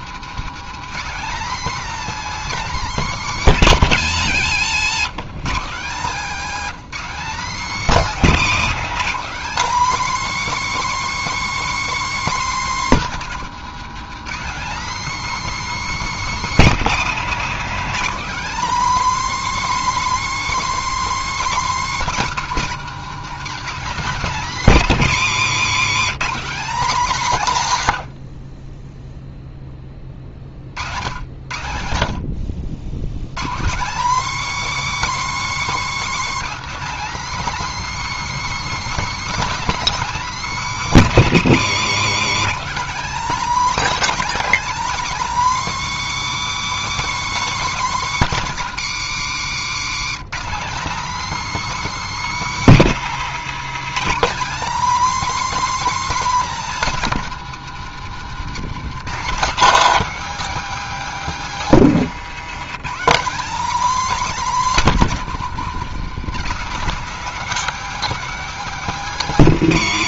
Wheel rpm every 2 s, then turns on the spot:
220, 270, 140, 250, 260, 320, 270, 250, 260, 280, 310, 240, 230, 230, 30, 50, 80, 310, 300, 310, 270, 230, 300, 320, 230, 230, 280, 270, 270, 180, 270, 220, 250, 210, 270.
8-10